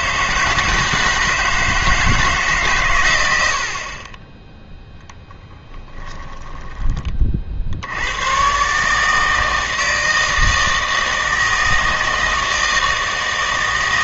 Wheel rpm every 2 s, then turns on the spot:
160, 150, 0, 20, 140, 160, 160.
none